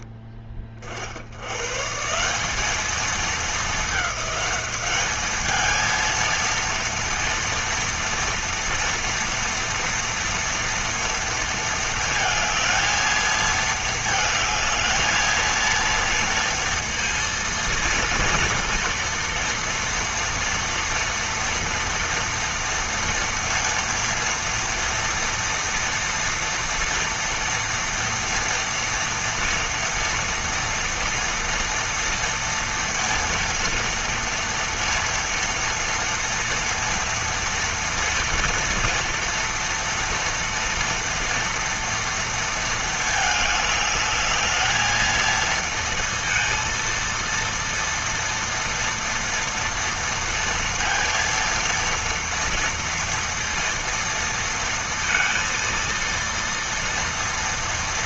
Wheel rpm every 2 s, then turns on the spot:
40, 220, 210, 230, 230, 230, 220, 220, 230, 240, 230, 230, 230, 230, 230, 230, 230, 230, 230, 230, 230, 220, 220, 230, 230, 230, 230, 230, 230.
none